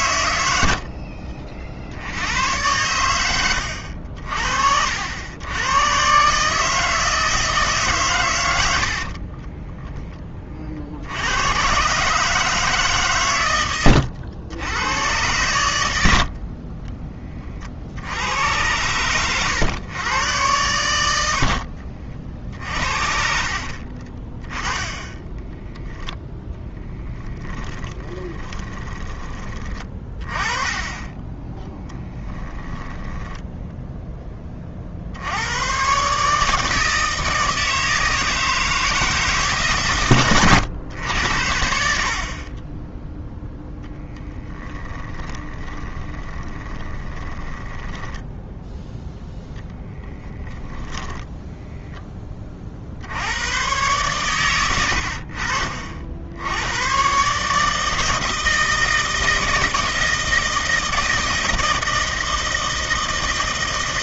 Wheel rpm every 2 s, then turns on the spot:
60, 100, 70, 160, 80, 50, 140, 100, 30, 100, 90, 50, 10, 10, 20, 20, 10, 50, 160, 160, 100, 10, 10, 20, 10, 20, 60, 90, 100, 160, 160, 160.
8-10 24-30 44-48 54-56